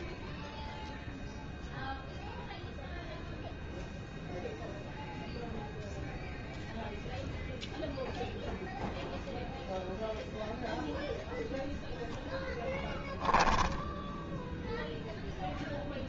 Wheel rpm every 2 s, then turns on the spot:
0, 0, 0, 0, 0, 0, 0, 10.
none